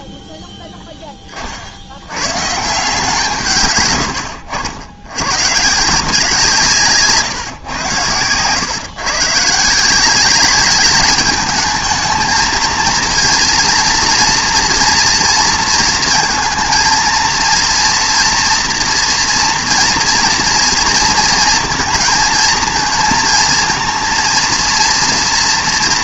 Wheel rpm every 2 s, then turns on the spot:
10, 140, 90, 160, 120, 210, 230, 240, 220, 240, 230, 230, 230.
none